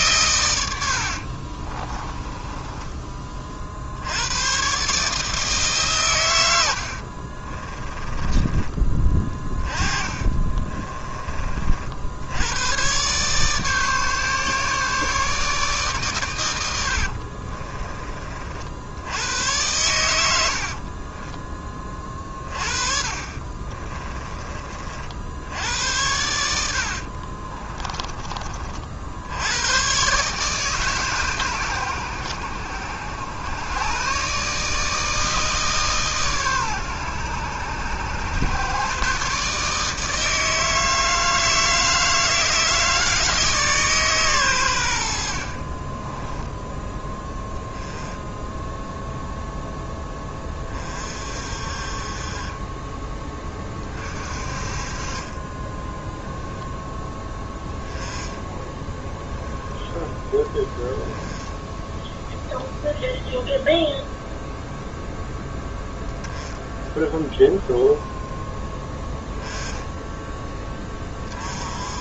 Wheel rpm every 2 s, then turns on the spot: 110, 20, 130, 120, 20, 30, 100, 150, 90, 50, 70, 50, 30, 80, 40, 150, 90, 150, 130, 120, 160, 160, 110, 10, 0, 30, 20, 40, 0, 10, 10, 10, 0, 10, 10, 20.
2-4 8-12 22-24 26-28 58-60